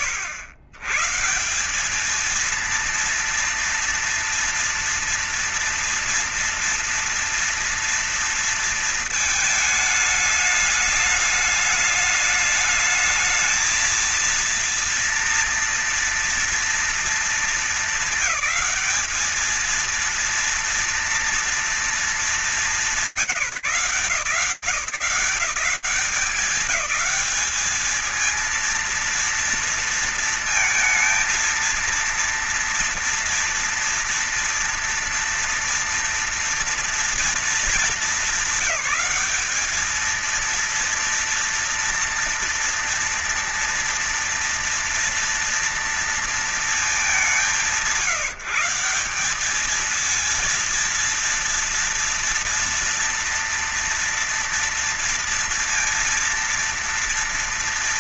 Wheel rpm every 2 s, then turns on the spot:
110, 230, 230, 230, 230, 210, 210, 230, 230, 200, 230, 190, 180, 200, 230, 230, 230, 230, 230, 200, 230, 240, 230, 200, 200, 230, 230, 230, 230.
none